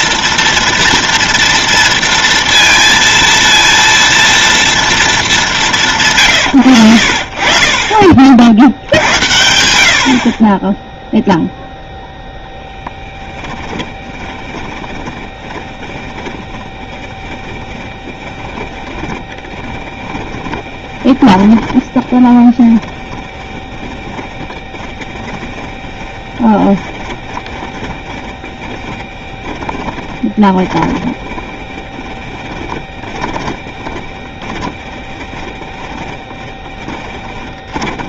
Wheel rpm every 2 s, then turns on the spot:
230, 230, 230, 80, 70, 0, 0, 20, 10, 20, 20, 20, 20, 20, 10, 20, 10, 10, 10.
14-38